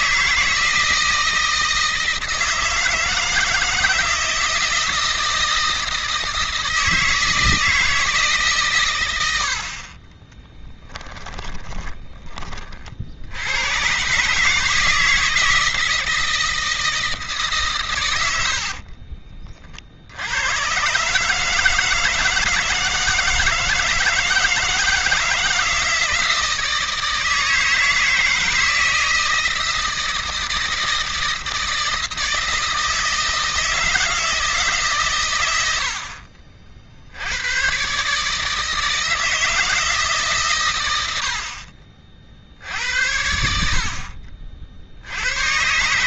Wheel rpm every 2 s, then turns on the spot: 160, 160, 160, 160, 130, 10, 40, 140, 160, 70, 100, 160, 160, 160, 160, 160, 160, 150, 60, 150, 130, 50, 50.
10-12 18-20